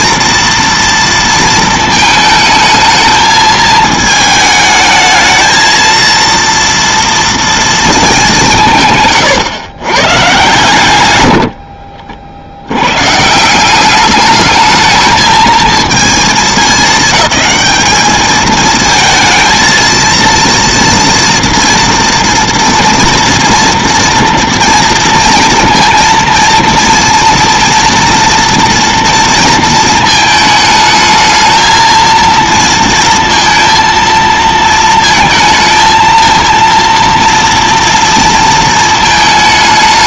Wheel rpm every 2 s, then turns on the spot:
230, 220, 220, 230, 170, 120, 80, 210, 220, 220, 230, 230, 230, 230, 240, 220, 230, 230, 230, 230.
none